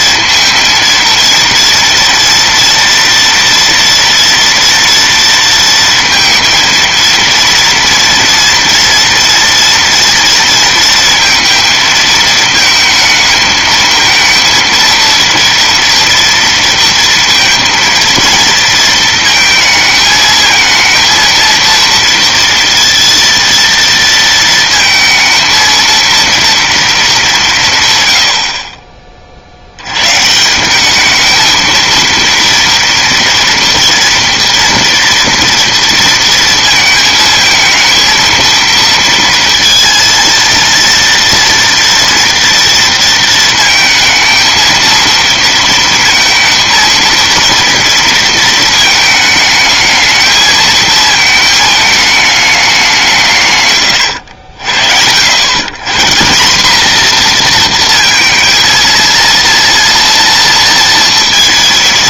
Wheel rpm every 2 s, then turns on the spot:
230, 230, 230, 230, 230, 230, 220, 230, 230, 230, 220, 230, 230, 230, 50, 180, 230, 230, 230, 230, 230, 230, 230, 230, 220, 220, 200, 60, 210, 230, 230.
none